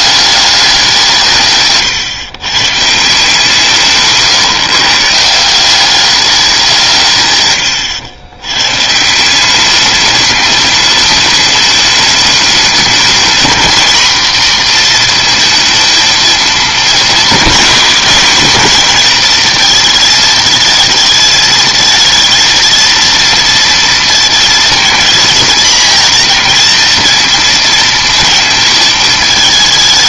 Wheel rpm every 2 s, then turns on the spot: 200, 120, 150, 190, 110, 210, 210, 240, 220, 230, 220, 230, 230, 230, 220.
none